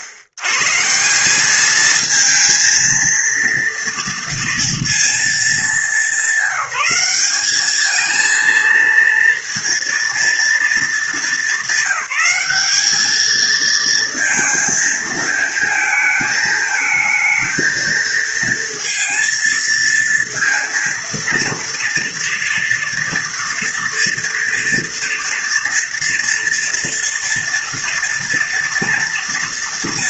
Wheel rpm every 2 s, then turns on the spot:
120, 220, 230, 190, 220, 230, 200, 230, 220, 230, 230, 230, 230, 230, 230.
none